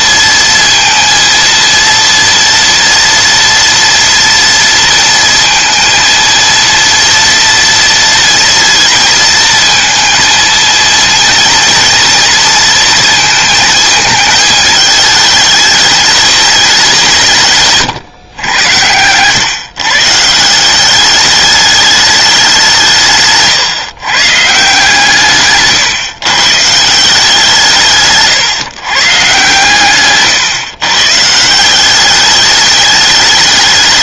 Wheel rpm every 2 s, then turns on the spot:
230, 230, 230, 230, 230, 230, 230, 220, 200, 110, 190, 170, 160, 160, 140, 130, 210.
18-20